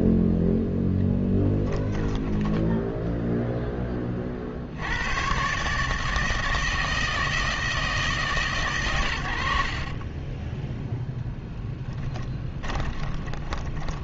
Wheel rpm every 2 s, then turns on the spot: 0, 0, 70, 160, 140, 0, 20.
12-14